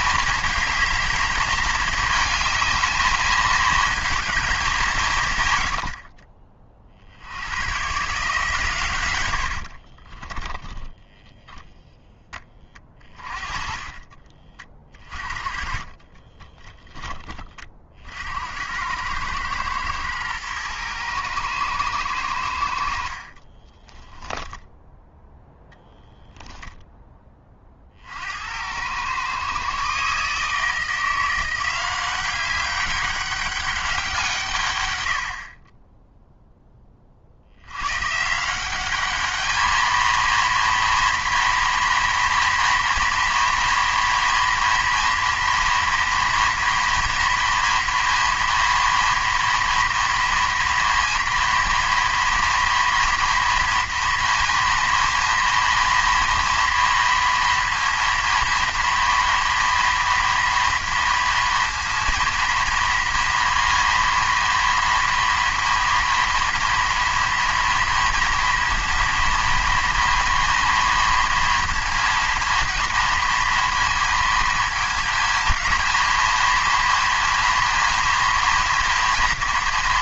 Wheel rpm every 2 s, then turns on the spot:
220, 220, 180, 50, 130, 10, 20, 30, 10, 80, 110, 70, 0, 10, 90, 160, 190, 120, 10, 180, 230, 230, 240, 240, 230, 230, 240, 230, 230, 230, 230, 230, 230, 240, 230, 230, 230, 230, 230, 240.
10-12 14-18 26-28